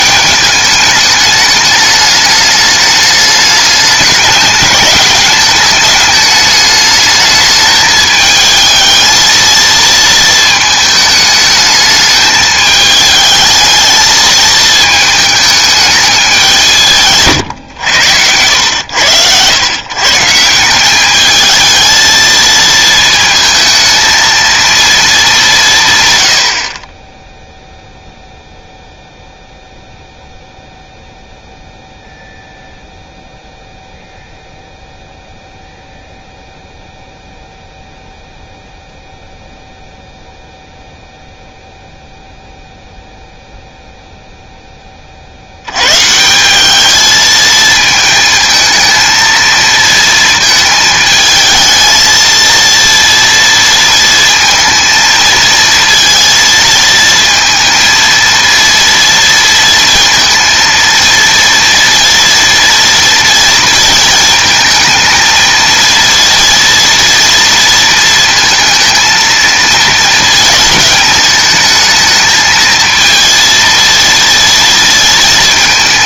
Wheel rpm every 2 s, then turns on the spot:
210, 210, 200, 210, 220, 220, 220, 220, 180, 100, 180, 230, 230, 40, 0, 0, 0, 0, 0, 0, 0, 0, 10, 200, 220, 220, 230, 230, 230, 230, 230, 230, 220, 230, 230, 220, 220, 230.
none